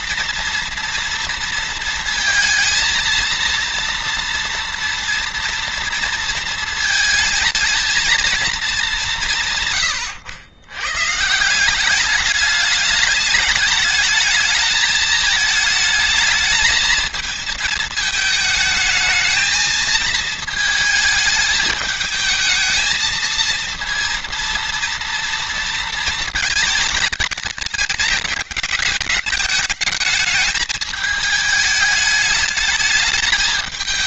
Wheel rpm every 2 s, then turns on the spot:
230, 230, 230, 220, 190, 130, 210, 220, 220, 220, 220, 220, 230, 210, 210, 210, 210.
none